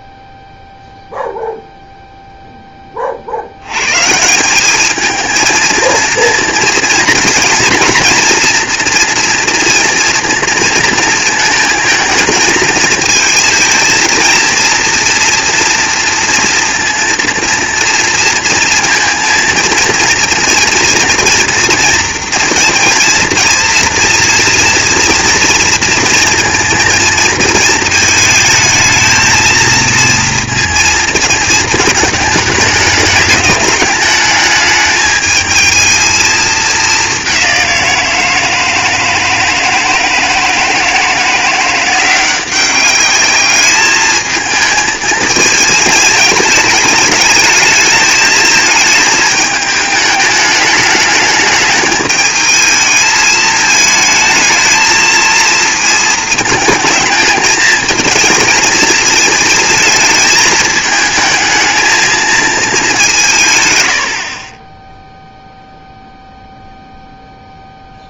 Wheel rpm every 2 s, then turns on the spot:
0, 20, 200, 230, 230, 230, 220, 230, 230, 230, 230, 230, 230, 230, 220, 230, 210, 210, 210, 160, 170, 190, 220, 210, 220, 220, 220, 220, 220, 220, 220, 210, 50, 0.
none